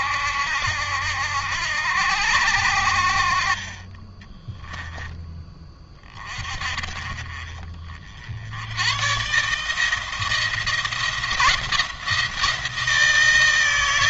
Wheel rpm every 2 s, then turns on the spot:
70, 70, 10, 40, 100, 170, 160.
none